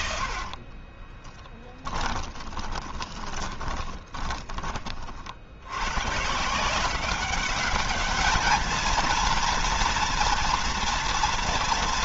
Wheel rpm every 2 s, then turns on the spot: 10, 20, 50, 180, 230, 230.
0-4